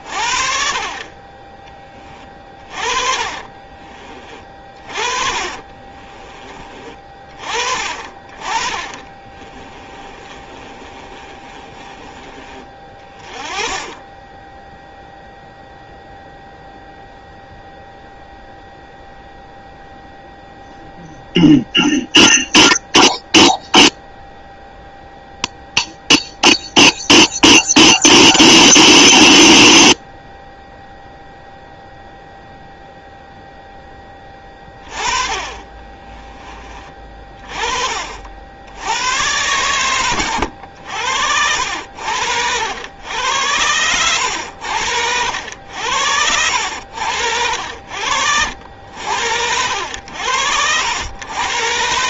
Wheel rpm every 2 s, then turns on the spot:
40, 30, 40, 30, 30, 30, 30, 0, 0, 0, 0, 0, 0, 0, 0, 0, 0, 20, 30, 80, 90, 90, 80, 80, 80, 80.
2-6 10-12 46-48